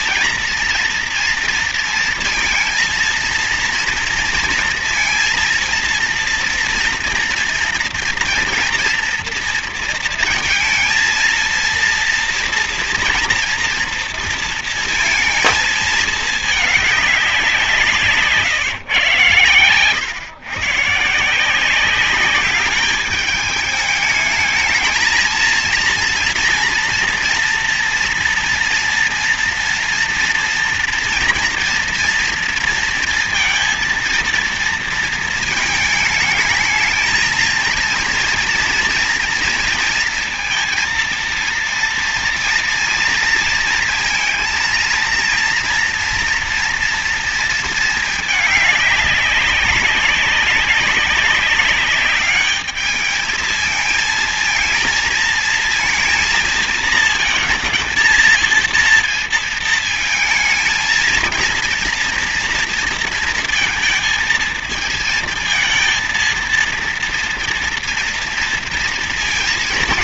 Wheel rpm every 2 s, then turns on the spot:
230, 230, 230, 230, 230, 230, 240, 230, 220, 140, 130, 200, 220, 240, 230, 230, 230, 230, 220, 230, 230, 230, 230, 230, 220, 200, 210, 220, 230, 230, 230, 230, 230, 230, 230.
none